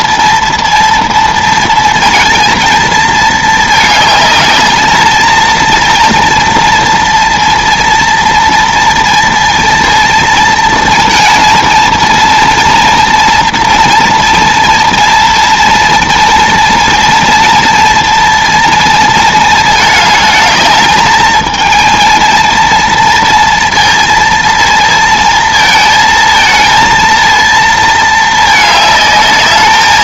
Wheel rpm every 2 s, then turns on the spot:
230, 230, 220, 230, 230, 230, 230, 230, 230, 230, 210, 230, 230, 230, 220.
none